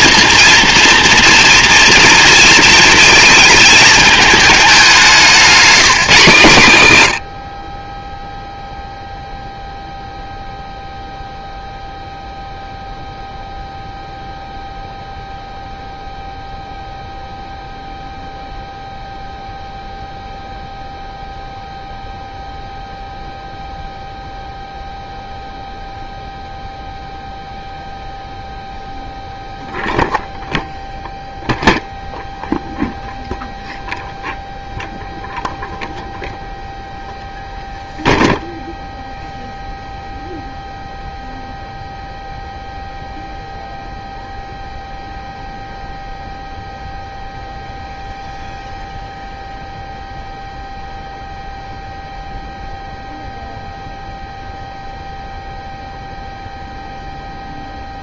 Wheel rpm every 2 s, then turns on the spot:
240, 230, 210, 130, 0, 0, 0, 0, 0, 0, 0, 0, 0, 0, 0, 0, 0, 0, 0, 0, 0, 0, 0, 0, 0, 0, 0, 0, 0.
none